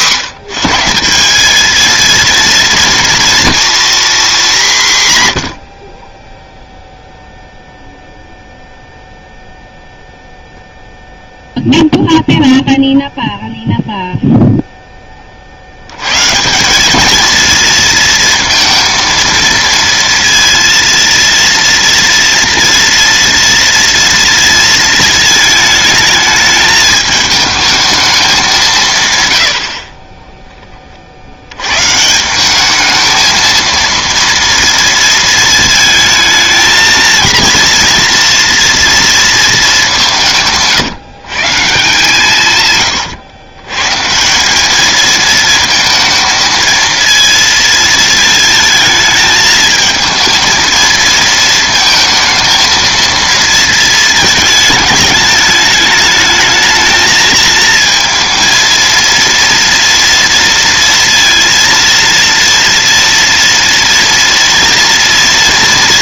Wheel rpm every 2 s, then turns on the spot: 180, 230, 180, 0, 0, 0, 0, 0, 180, 230, 230, 230, 230, 220, 190, 20, 200, 230, 220, 230, 150, 150, 200, 220, 220, 230, 230, 220, 220, 230, 230, 230, 240.
40-42